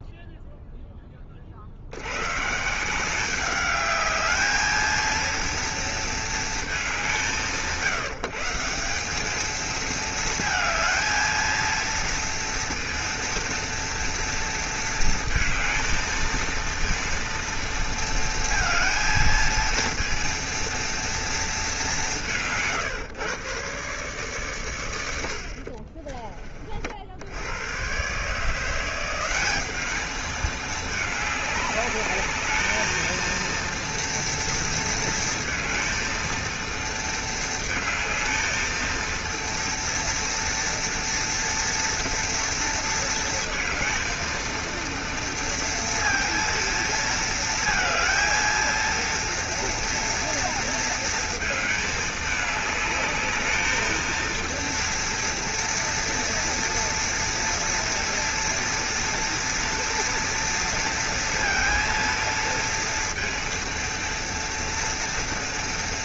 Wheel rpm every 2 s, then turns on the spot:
10, 160, 220, 180, 180, 220, 230, 230, 230, 230, 230, 150, 120, 40, 170, 210, 220, 230, 230, 230, 230, 230, 230, 230, 230, 230, 210, 230, 230, 230, 230, 230, 230.
none